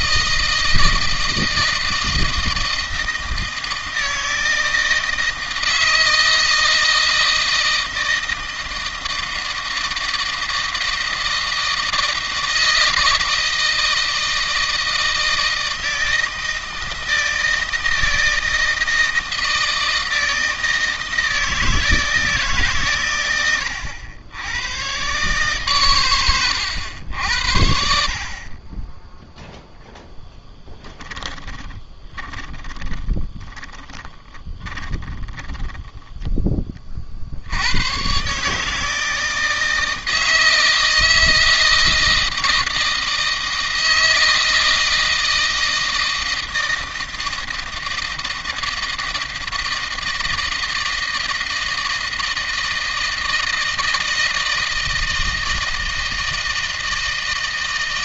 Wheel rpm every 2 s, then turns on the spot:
160, 160, 160, 160, 160, 160, 160, 160, 160, 160, 160, 150, 100, 100, 30, 10, 20, 10, 20, 140, 160, 160, 160, 160, 160, 160, 160, 160, 160.
32-36